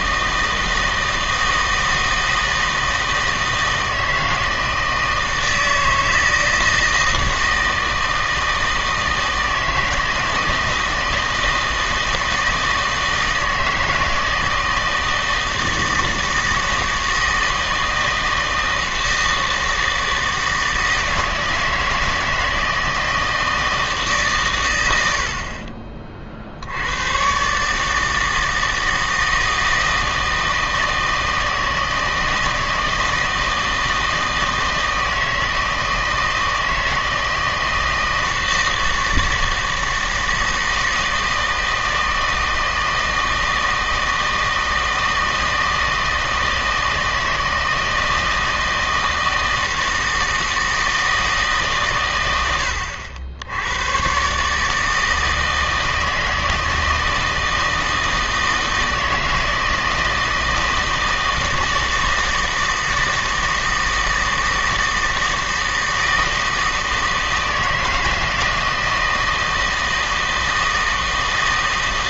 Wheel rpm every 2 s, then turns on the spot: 160, 160, 160, 160, 160, 160, 160, 160, 160, 160, 160, 160, 110, 70, 160, 160, 160, 160, 160, 160, 160, 160, 160, 160, 160, 160, 80, 160, 160, 160, 160, 160, 160, 160, 160, 160.
none